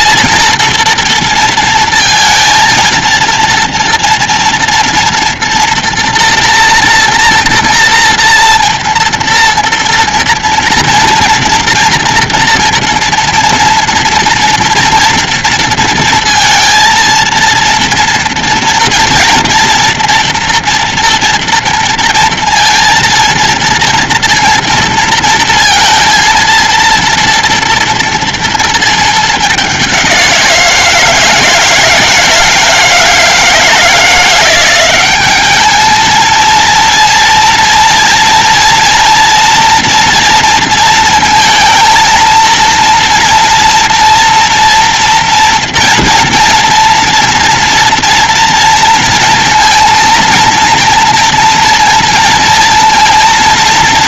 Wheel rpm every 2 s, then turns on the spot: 230, 230, 230, 230, 230, 230, 230, 230, 230, 230, 230, 230, 230, 230, 220, 170, 160, 190, 230, 230, 230, 230, 230, 230, 230, 230, 230.
none